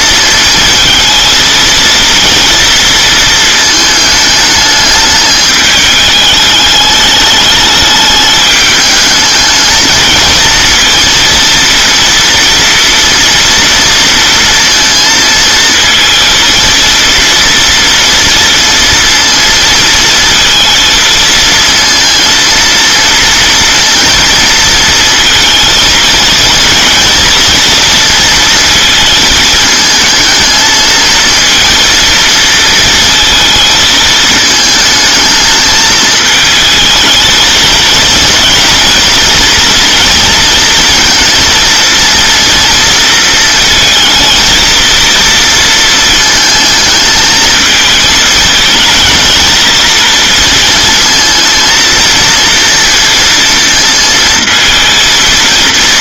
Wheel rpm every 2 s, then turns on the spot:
220, 230, 210, 210, 220, 230, 240, 230, 230, 230, 220, 230, 230, 230, 230, 220, 230, 220, 220, 230, 230, 230, 230, 220, 220, 230, 230, 220.
none